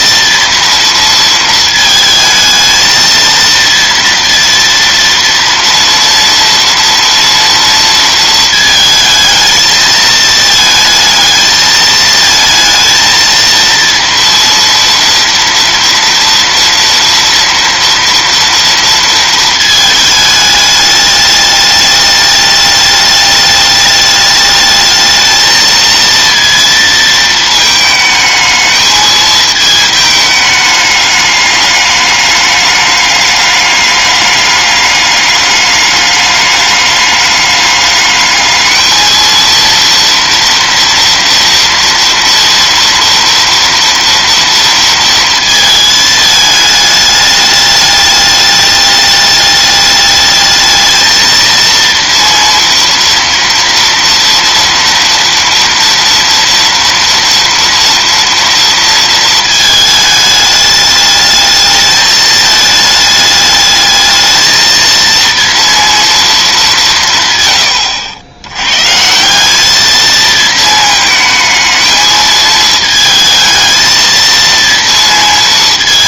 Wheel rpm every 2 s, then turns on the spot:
230, 220, 230, 230, 220, 220, 230, 230, 230, 230, 210, 210, 220, 220, 220, 210, 200, 200, 210, 220, 230, 230, 230, 210, 210, 220, 230, 230, 230, 230, 210, 210, 230, 160, 140, 220, 220, 230.
none